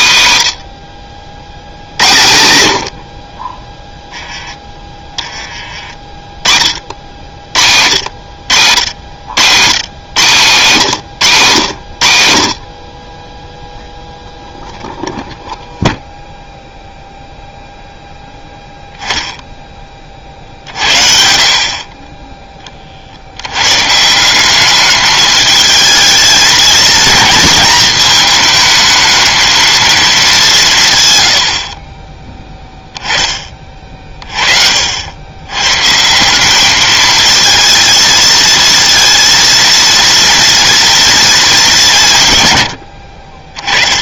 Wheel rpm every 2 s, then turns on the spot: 70, 40, 20, 70, 90, 110, 10, 0, 0, 10, 60, 70, 210, 230, 220, 90, 20, 80, 220, 230, 230, 70.
none